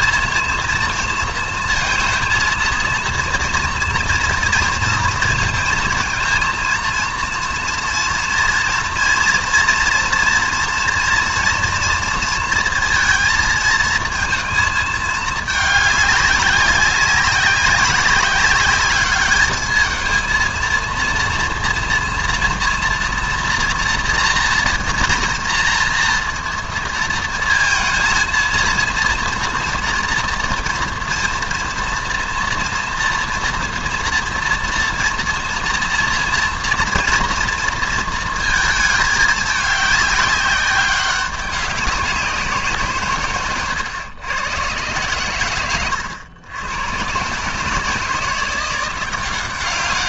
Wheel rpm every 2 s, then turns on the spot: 230, 230, 230, 230, 230, 240, 230, 220, 190, 200, 230, 240, 230, 230, 230, 240, 240, 230, 230, 220, 200, 160, 120, 100, 170.
none